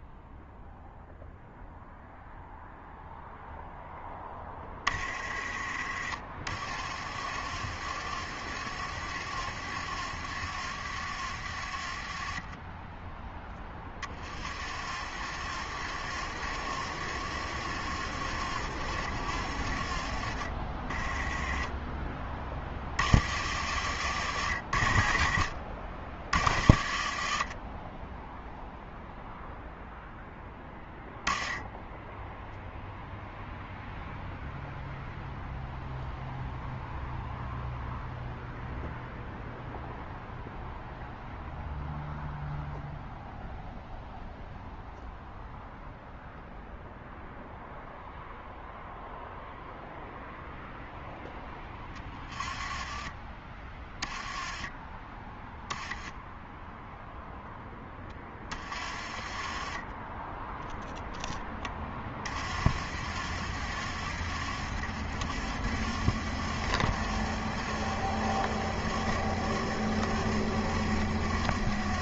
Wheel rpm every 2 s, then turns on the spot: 0, 0, 20, 40, 50, 50, 20, 40, 50, 40, 30, 30, 60, 50, 0, 10, 0, 0, 0, 0, 0, 0, 0, 0, 0, 0, 20, 10, 0, 20, 0, 40, 40, 50, 50, 50.
none